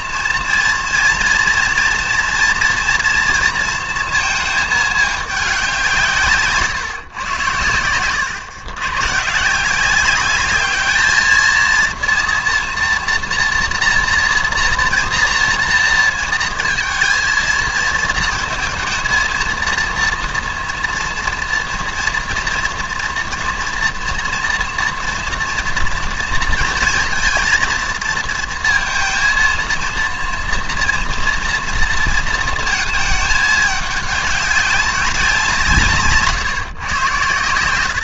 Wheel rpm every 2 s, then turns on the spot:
230, 230, 220, 140, 110, 210, 230, 230, 220, 230, 240, 230, 230, 230, 230, 230, 220, 200, 140.
none